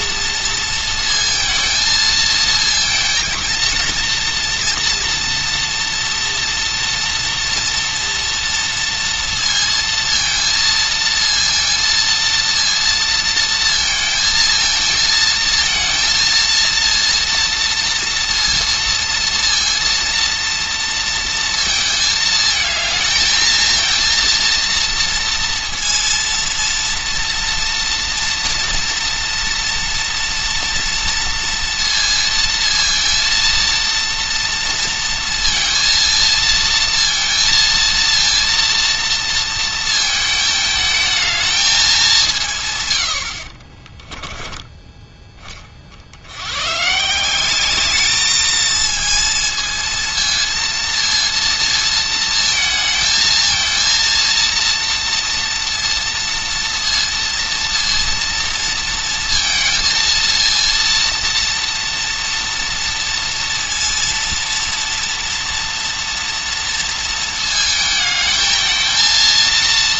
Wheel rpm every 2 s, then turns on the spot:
230, 230, 240, 230, 230, 230, 230, 230, 230, 230, 220, 230, 230, 230, 230, 230, 230, 230, 230, 220, 200, 30, 30, 200, 230, 230, 230, 230, 230, 230, 230, 230, 230, 220, 230.
42-44